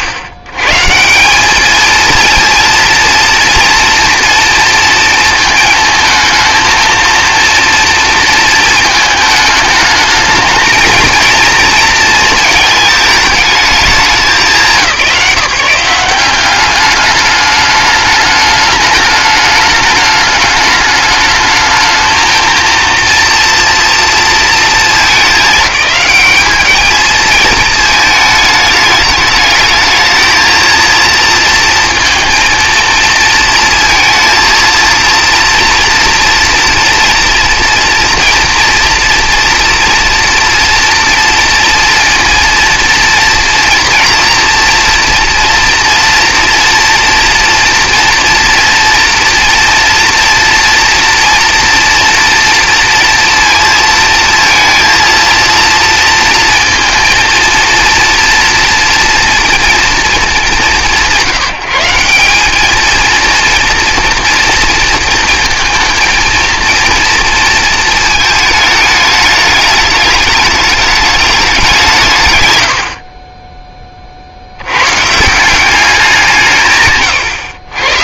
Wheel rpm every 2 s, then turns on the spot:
130, 230, 230, 230, 220, 220, 220, 170, 200, 210, 210, 230, 220, 220, 210, 230, 230, 230, 230, 230, 240, 240, 230, 230, 230, 230, 230, 230, 230, 230, 180, 210, 230, 230, 220, 210, 90, 90, 150.
none